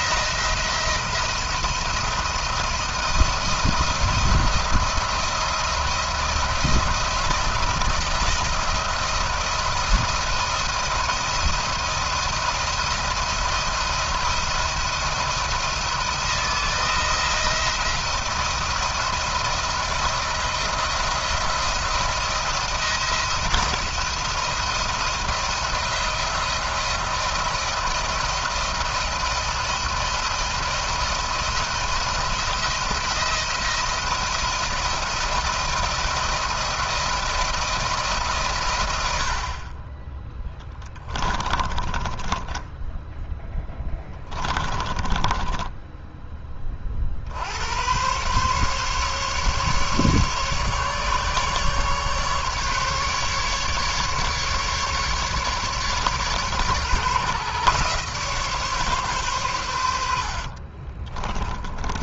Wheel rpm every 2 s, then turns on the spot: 170, 170, 170, 170, 170, 170, 170, 170, 160, 170, 170, 170, 170, 170, 170, 170, 170, 170, 170, 100, 20, 10, 20, 20, 140, 140, 150, 150, 140, 140, 40.
40-46 60-62